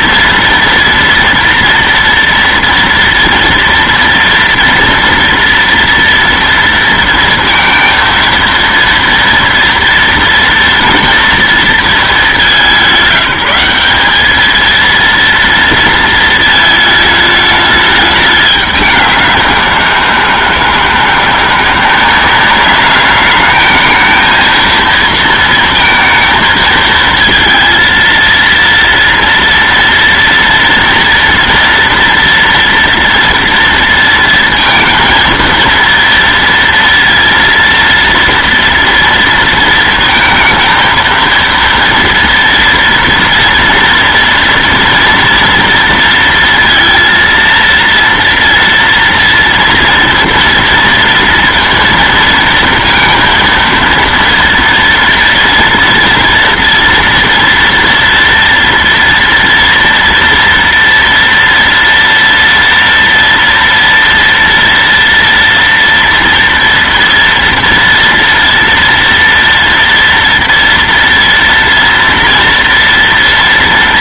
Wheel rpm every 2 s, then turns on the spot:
230, 230, 230, 230, 230, 230, 180, 230, 220, 190, 160, 210, 230, 230, 230, 230, 230, 230, 230, 230, 230, 230, 230, 230, 230, 230, 230, 230, 230, 230, 230, 240, 230, 230, 230, 230, 230.
none